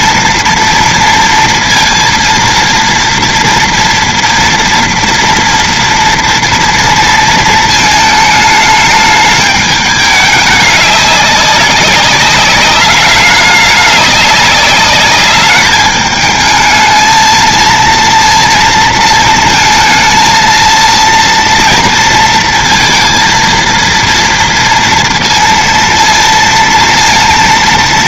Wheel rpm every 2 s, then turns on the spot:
230, 230, 230, 230, 220, 210, 200, 200, 220, 230, 230, 230, 230, 230.
none